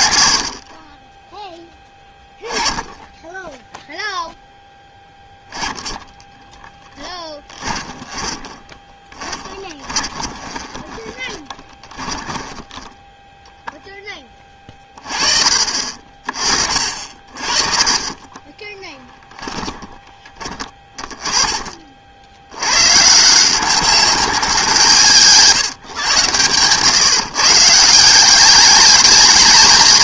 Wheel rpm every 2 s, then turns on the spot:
50, 10, 0, 0, 20, 20, 10, 30, 50, 20, 20, 100, 180, 130, 200.
8-12 18-22